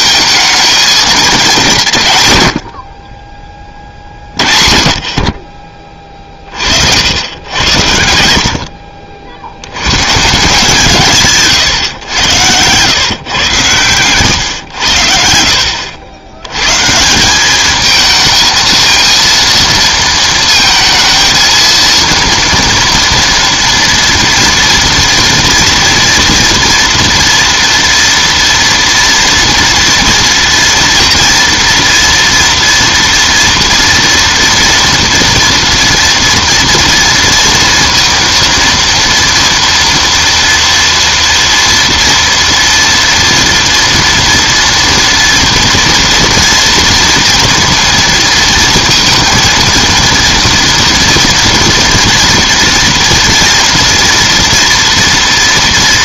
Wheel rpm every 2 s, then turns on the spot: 220, 70, 40, 40, 70, 150, 120, 100, 130, 220, 230, 230, 230, 240, 230, 230, 230, 230, 230, 230, 230, 230, 230, 230, 230, 230, 230, 230.
none